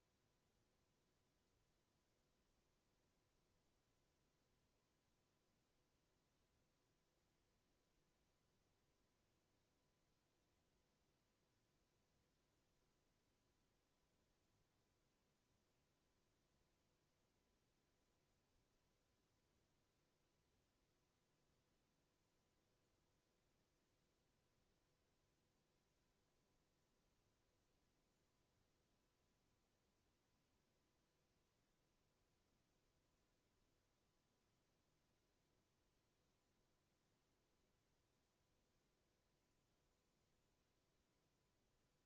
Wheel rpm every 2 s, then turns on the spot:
0, 0, 0, 0, 0, 0, 0, 0, 0, 0, 0, 0, 0, 0, 0, 0, 0, 0, 0, 0, 0.
none